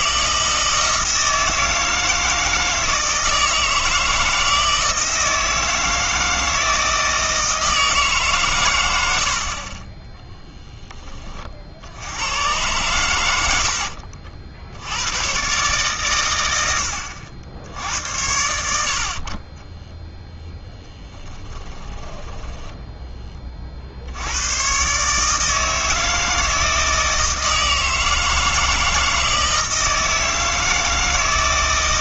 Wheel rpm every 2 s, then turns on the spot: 160, 160, 160, 160, 100, 20, 100, 80, 80, 60, 0, 10, 120, 160, 160, 160.
22-24